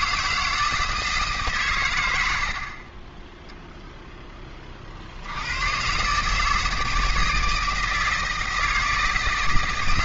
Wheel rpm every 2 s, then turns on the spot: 160, 30, 50, 160, 160.
2-4